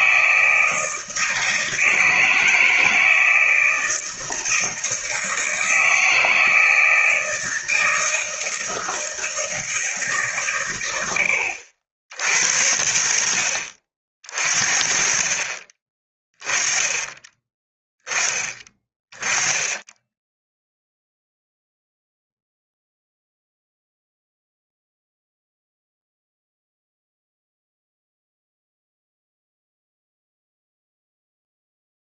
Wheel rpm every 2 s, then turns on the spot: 160, 160, 160, 160, 160, 120, 70, 40, 20, 20, 0, 0, 0, 0, 0, 0.
none